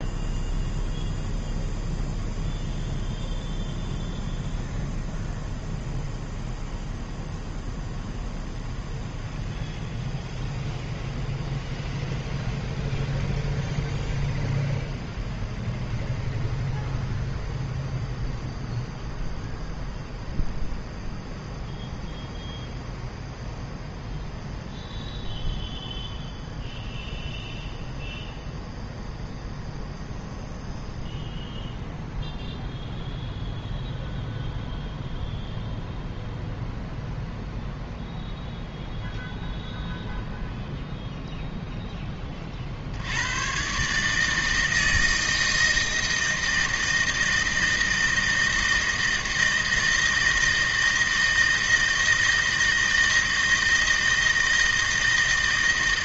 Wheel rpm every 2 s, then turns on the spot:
0, 0, 0, 0, 0, 0, 0, 0, 0, 0, 0, 0, 0, 0, 0, 0, 0, 0, 0, 0, 0, 30, 160, 160, 160, 160, 160, 160.
none